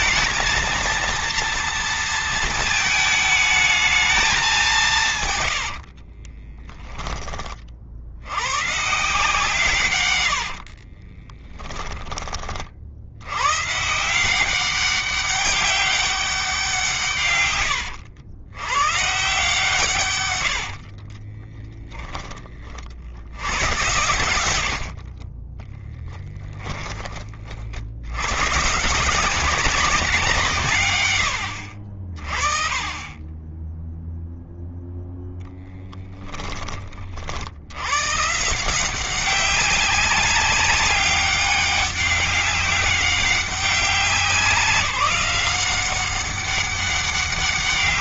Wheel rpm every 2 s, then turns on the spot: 230, 220, 190, 20, 130, 40, 50, 190, 160, 120, 60, 50, 60, 20, 150, 130, 30, 0, 40, 170, 190, 190, 190, 200.
6-8 10-12 20-22